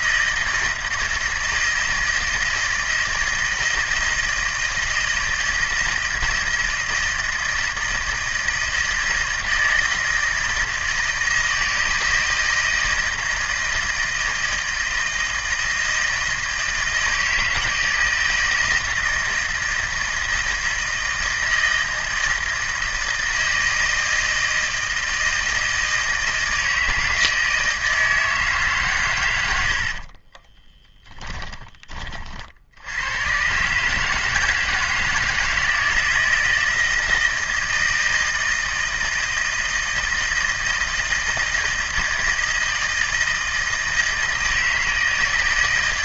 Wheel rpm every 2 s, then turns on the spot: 160, 160, 160, 160, 160, 160, 160, 160, 160, 160, 160, 160, 160, 160, 150, 30, 70, 160, 160, 160, 160, 160, 160.
30-32